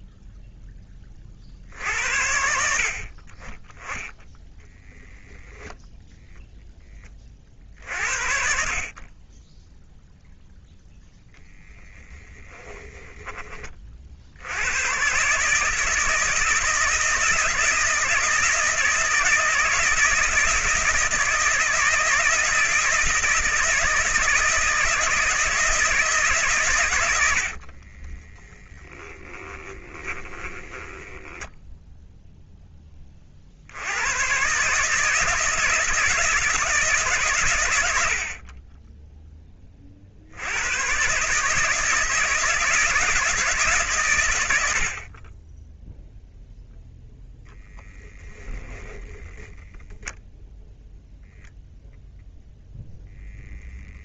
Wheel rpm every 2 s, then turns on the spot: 10, 60, 10, 10, 40, 0, 10, 110, 160, 160, 160, 160, 160, 110, 10, 10, 10, 150, 150, 20, 110, 160, 70, 0, 10, 0, 0.
12-14 28-32 48-50